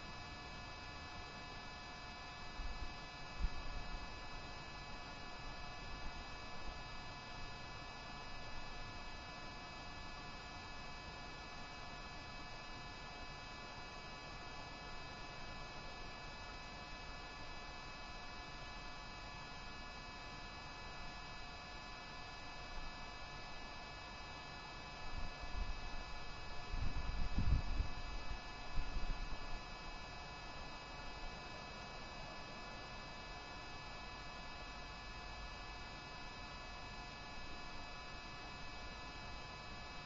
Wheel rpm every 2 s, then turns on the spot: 0, 0, 0, 0, 0, 0, 0, 0, 0, 0, 0, 0, 0, 0, 0, 0, 0, 0, 0, 0.
none